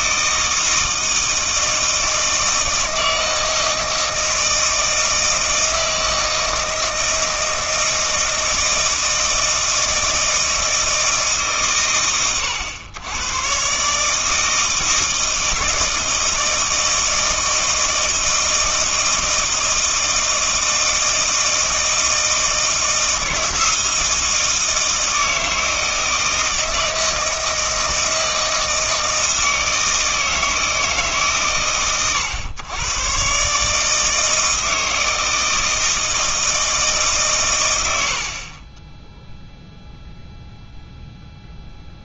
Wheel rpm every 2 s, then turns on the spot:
160, 160, 160, 160, 160, 160, 110, 160, 160, 160, 160, 160, 160, 160, 160, 160, 120, 160, 160, 30, 0.
none